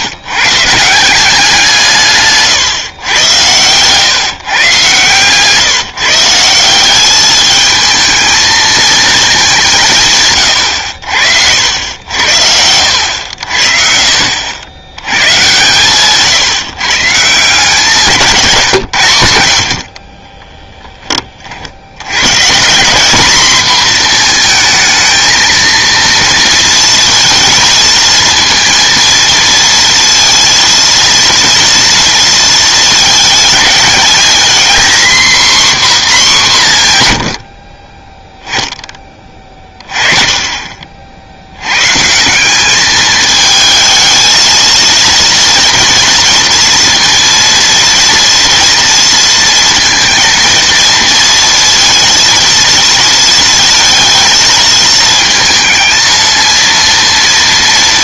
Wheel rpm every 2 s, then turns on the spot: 160, 120, 130, 190, 220, 90, 90, 110, 150, 130, 10, 190, 220, 230, 230, 230, 220, 240, 160, 20, 40, 210, 230, 230, 230, 230, 230, 220, 220.
none